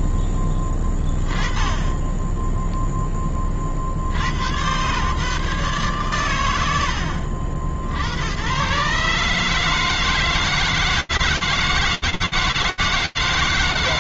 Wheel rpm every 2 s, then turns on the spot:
10, 10, 120, 90, 120, 160, 160.
none